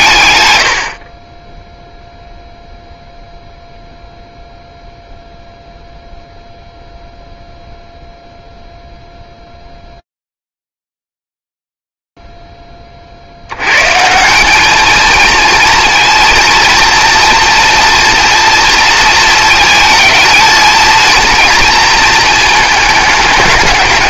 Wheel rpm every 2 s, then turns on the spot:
30, 0, 0, 0, 0, 80, 230, 230, 220, 230, 220, 220.
none